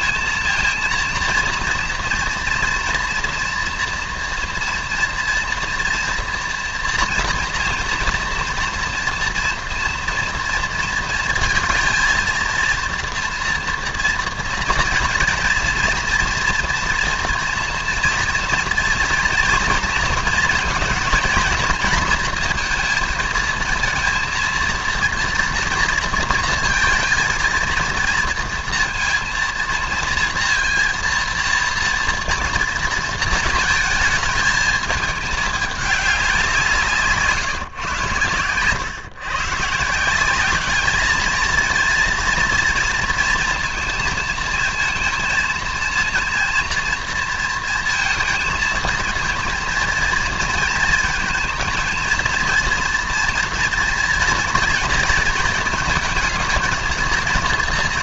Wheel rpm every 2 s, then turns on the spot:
230, 240, 230, 230, 230, 230, 230, 240, 230, 230, 220, 230, 230, 220, 230, 230, 230, 220, 180, 120, 210, 230, 230, 230, 230, 230, 240, 230, 220.
none